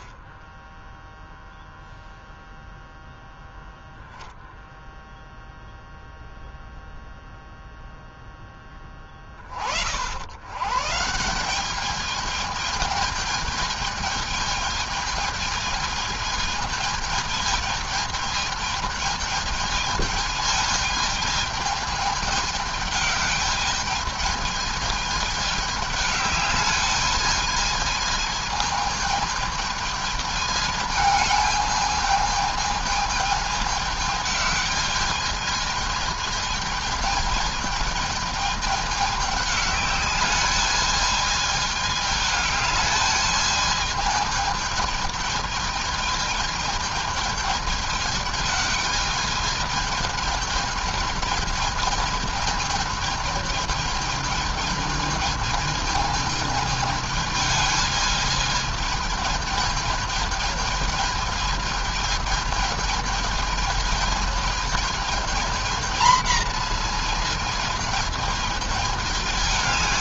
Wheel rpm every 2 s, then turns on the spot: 10, 0, 0, 0, 10, 100, 210, 220, 220, 220, 220, 210, 220, 210, 220, 220, 220, 210, 220, 220, 210, 210, 220, 220, 210, 210, 220, 220, 220, 220, 220, 220, 220, 220, 220.
none